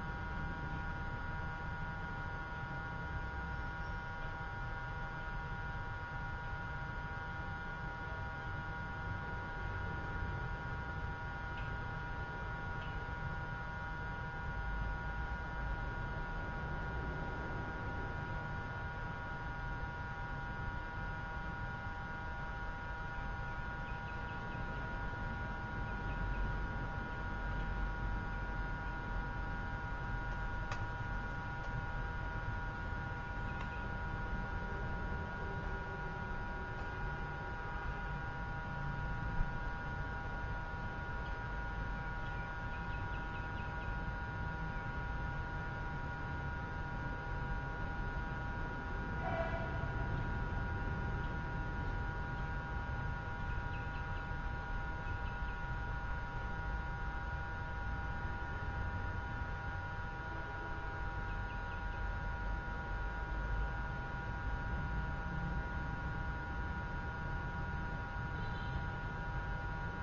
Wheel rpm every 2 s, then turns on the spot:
0, 0, 0, 0, 0, 0, 0, 0, 0, 0, 0, 0, 0, 0, 0, 0, 0, 0, 0, 0, 0, 0, 0, 0, 0, 0, 0, 0, 0, 0, 0, 0, 0, 0, 0.
none